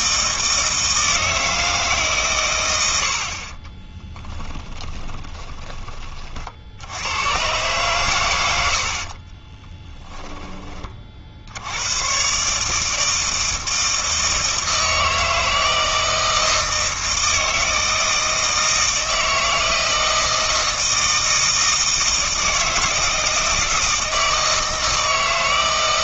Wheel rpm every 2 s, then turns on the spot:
160, 100, 10, 60, 70, 20, 150, 160, 160, 160, 160, 160, 160.
4-6